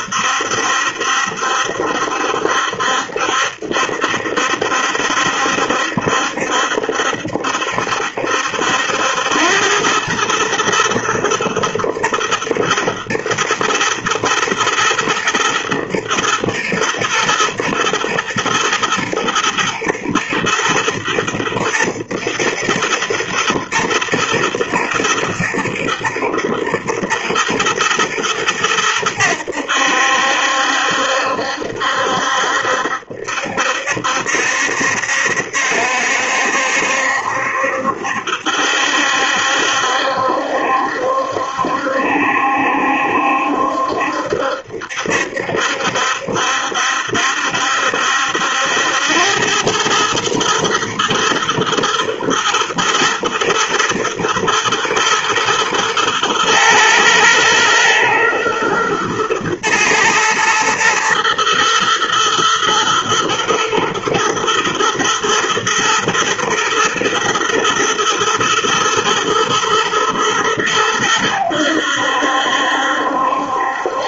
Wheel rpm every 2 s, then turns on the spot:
70, 70, 70, 70, 80, 110, 120, 120, 110, 120, 120, 110, 120, 110, 100, 70, 70, 70, 70, 70, 70, 70, 70, 70, 90, 120, 120, 110, 110, 110, 110, 120, 110, 110, 110, 100, 70.
none